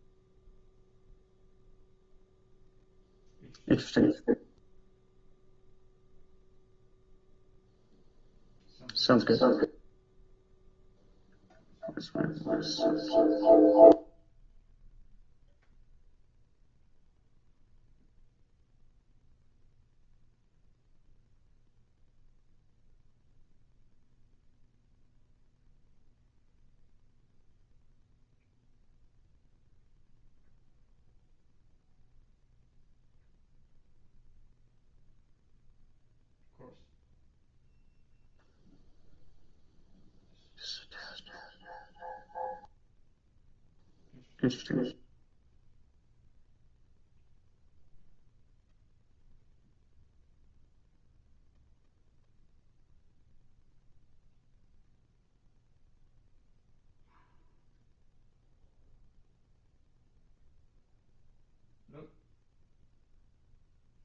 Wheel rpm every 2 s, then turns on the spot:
0, 0, 0, 0, 0, 0, 0, 0, 0, 0, 0, 0, 0, 0, 0, 0, 0, 0, 0, 0, 0, 0, 0, 0, 0, 0, 0, 0, 0, 0, 0, 0.
none